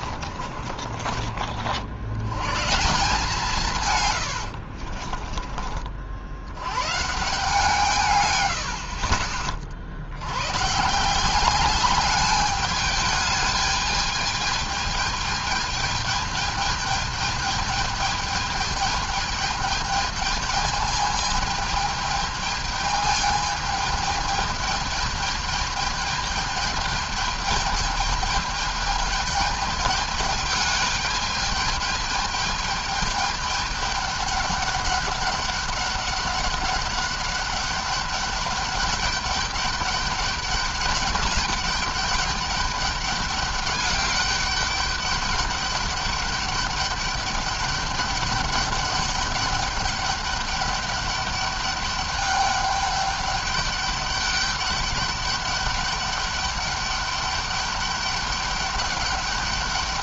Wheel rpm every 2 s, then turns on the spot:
40, 120, 80, 90, 100, 100, 200, 210, 210, 210, 210, 210, 210, 210, 210, 210, 210, 200, 200, 210, 210, 200, 200, 200, 200, 200, 200, 200, 200, 200.
0-2 4-6